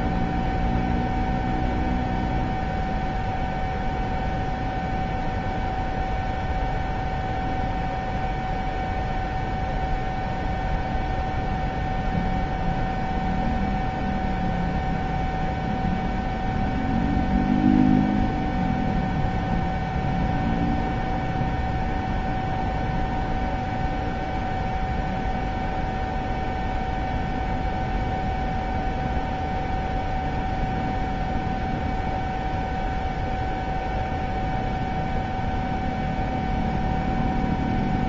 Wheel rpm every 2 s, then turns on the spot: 0, 0, 0, 0, 0, 0, 0, 0, 0, 0, 0, 0, 0, 0, 0, 0, 0, 0, 0.
none